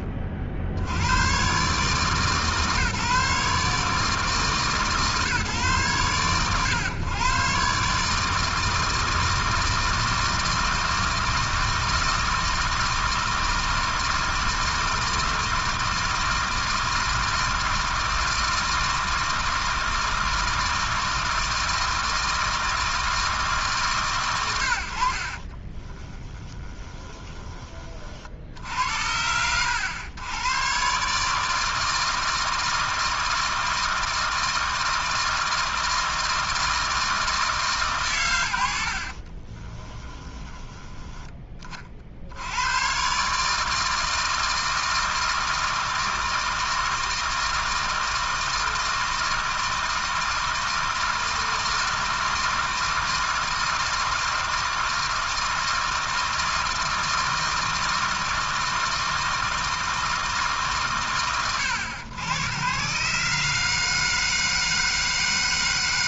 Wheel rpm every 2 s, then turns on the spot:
70, 140, 150, 120, 160, 160, 160, 160, 160, 160, 160, 160, 50, 30, 60, 140, 160, 160, 160, 60, 10, 120, 160, 160, 160, 160, 160, 160, 160, 160, 130, 130, 160.
26-28 38-42